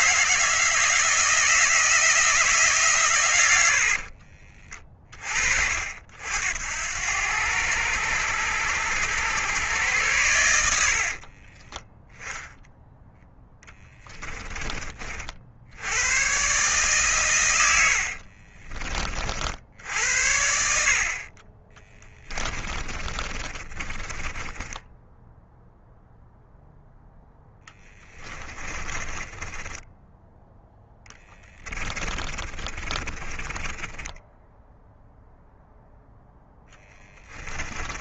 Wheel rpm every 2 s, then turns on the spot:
160, 150, 30, 80, 100, 80, 0, 30, 140, 30, 60, 30, 10, 0, 30, 10, 20, 0, 10.
10-12 22-26 28-34 36-38